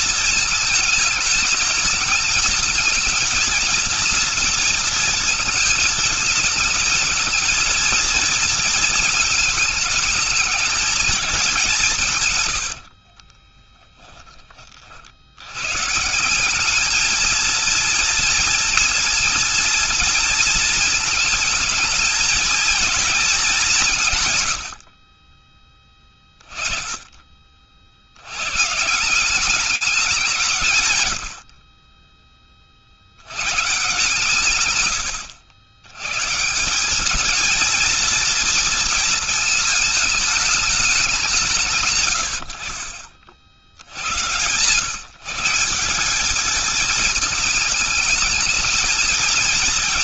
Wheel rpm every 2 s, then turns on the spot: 220, 220, 230, 220, 220, 210, 70, 50, 210, 230, 230, 230, 90, 20, 150, 110, 60, 120, 180, 230, 200, 70, 130, 220, 220.
12-14